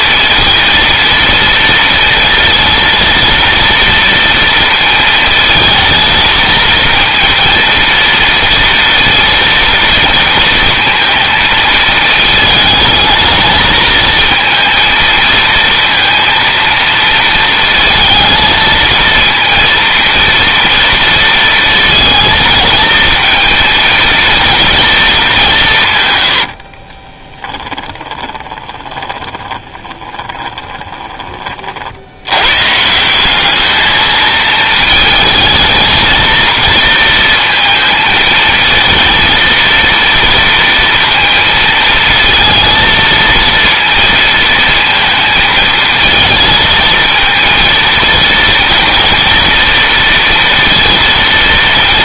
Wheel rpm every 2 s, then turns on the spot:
230, 230, 230, 230, 230, 230, 220, 230, 230, 230, 230, 220, 230, 30, 20, 20, 160, 220, 230, 230, 230, 230, 230, 220, 230, 230.
26-32